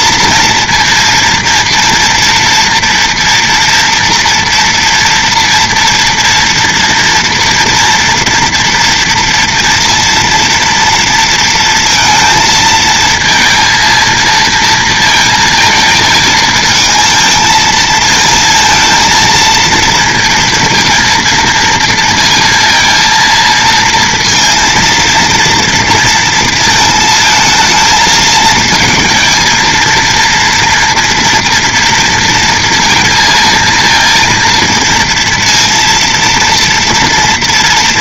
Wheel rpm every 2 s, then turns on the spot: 230, 230, 230, 230, 230, 230, 220, 230, 220, 230, 230, 230, 230, 230, 220, 230, 230, 230, 230.
none